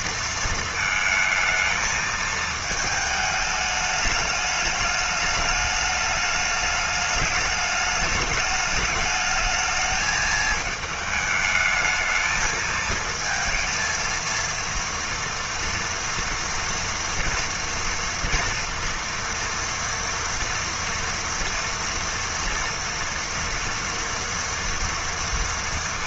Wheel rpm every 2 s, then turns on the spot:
220, 220, 210, 210, 220, 220, 220, 230, 230, 230, 230, 230, 230.
none